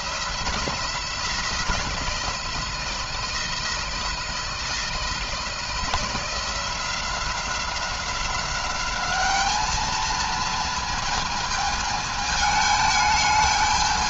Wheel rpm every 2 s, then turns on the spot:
170, 170, 160, 170, 200, 230, 220.
none